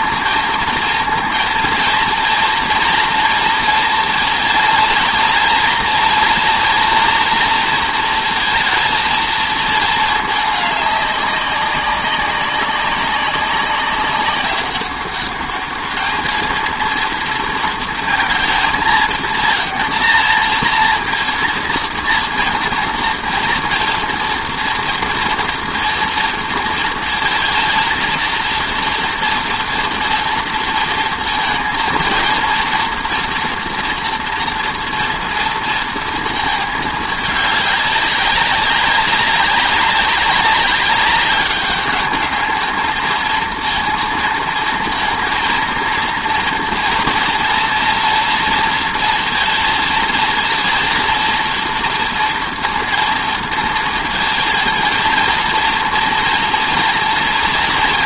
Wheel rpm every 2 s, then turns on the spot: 230, 230, 230, 240, 230, 210, 200, 200, 230, 230, 230, 230, 230, 230, 230, 230, 230, 230, 220, 190, 200, 220, 230, 230, 230, 230, 230, 230, 230.
none